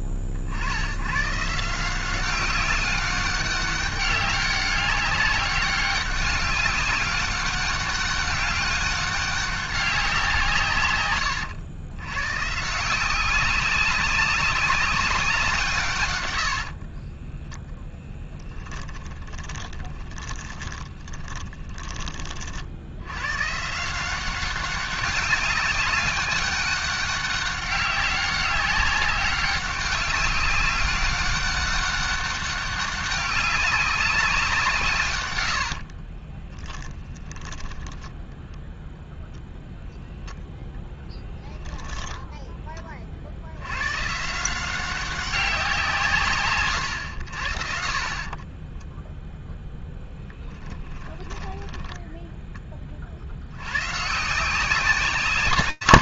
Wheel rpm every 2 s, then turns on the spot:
60, 190, 200, 200, 200, 170, 130, 190, 70, 20, 20, 50, 190, 200, 200, 200, 200, 180, 20, 10, 0, 10, 170, 120, 30, 20, 10, 170.
16-22 36-40 48-52